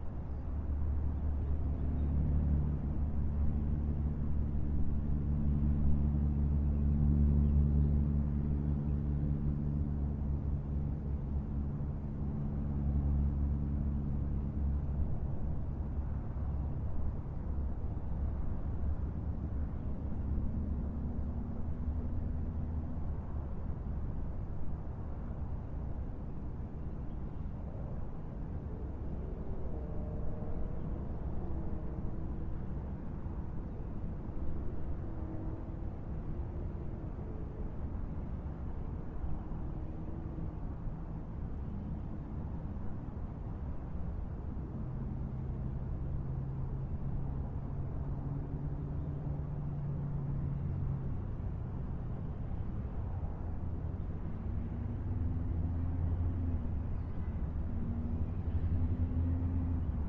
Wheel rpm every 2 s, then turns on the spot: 0, 0, 0, 0, 0, 0, 0, 0, 0, 0, 0, 0, 0, 0, 0, 0, 0, 0, 0, 0, 0, 0, 0, 0, 0, 0, 0, 0, 0, 0.
none